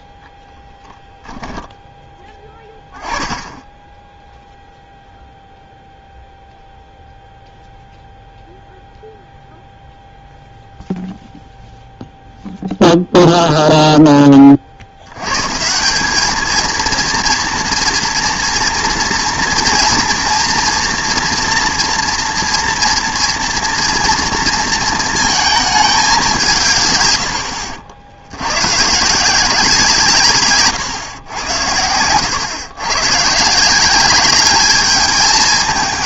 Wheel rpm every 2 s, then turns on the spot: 0, 10, 0, 0, 0, 0, 0, 50, 220, 230, 230, 230, 230, 160, 120, 130, 110, 210.
none